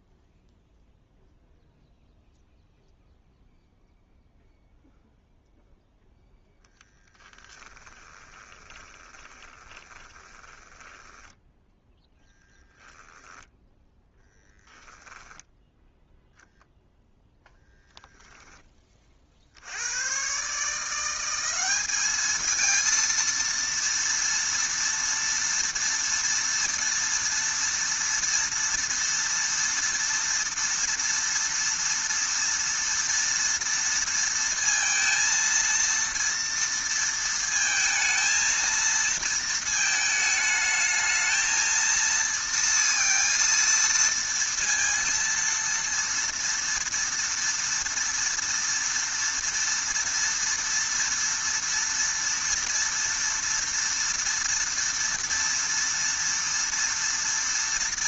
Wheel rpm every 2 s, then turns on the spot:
0, 0, 0, 10, 20, 10, 0, 0, 0, 20, 160, 230, 230, 230, 230, 230, 230, 230, 230, 230, 220, 230, 230, 230, 230, 230, 240, 230, 230.
8-12